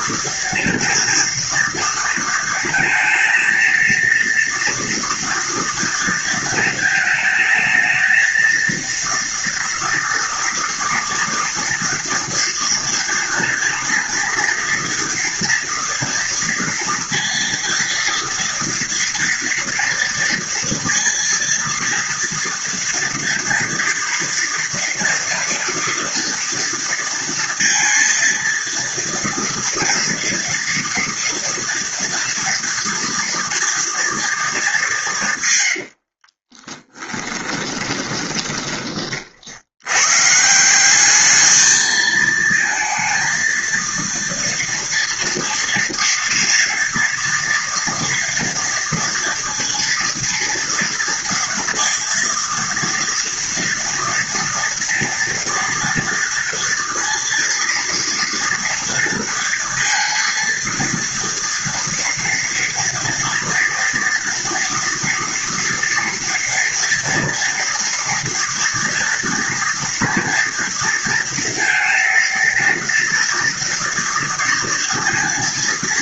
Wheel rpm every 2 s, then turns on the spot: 230, 220, 230, 220, 230, 230, 230, 230, 230, 230, 230, 230, 240, 230, 230, 230, 240, 220, 30, 20, 160, 230, 230, 230, 230, 230, 230, 240, 230, 230, 230, 240, 230, 230, 230, 230, 230, 230.
36-40